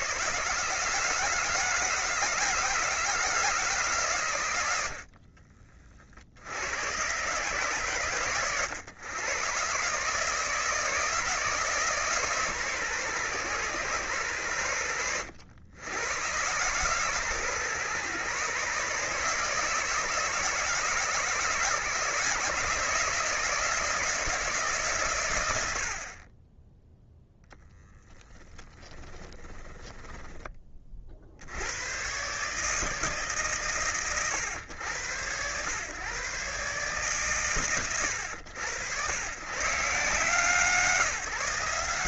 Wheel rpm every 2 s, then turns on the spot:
160, 160, 60, 110, 110, 160, 130, 100, 140, 150, 150, 160, 130, 0, 20, 50, 150, 100, 140, 110, 160.
28-30